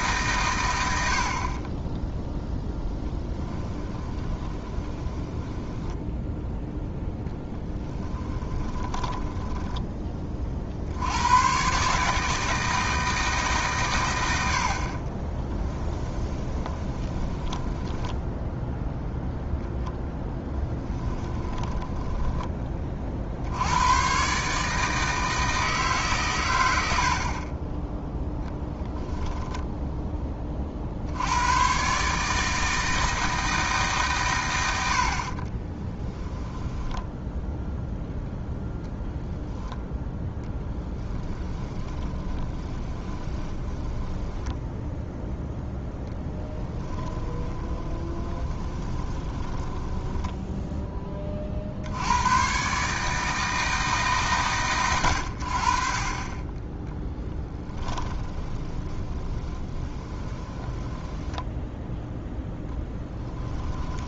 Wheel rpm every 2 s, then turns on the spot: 90, 10, 20, 0, 20, 70, 160, 50, 20, 0, 10, 30, 160, 80, 10, 50, 160, 80, 10, 10, 10, 20, 0, 10, 20, 10, 140, 90, 20, 30, 10, 10.
2-6 8-10 16-18 20-22 26-28 36-38 40-44 46-50 58-62